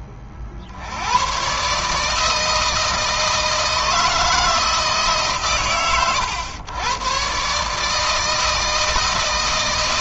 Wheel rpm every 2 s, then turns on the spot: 40, 160, 130, 110, 160.
none